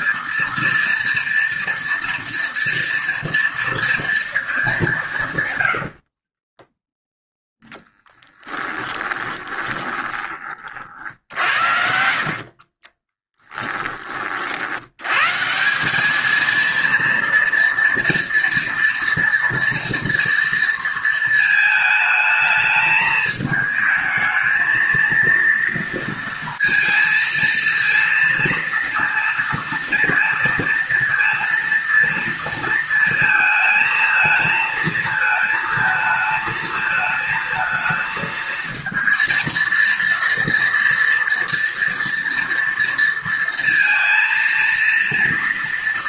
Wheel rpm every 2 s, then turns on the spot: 230, 230, 140, 0, 20, 60, 30, 110, 230, 230, 230, 220, 220, 230, 230, 230, 220, 220, 220, 230, 230, 230, 230.
4-6 8-14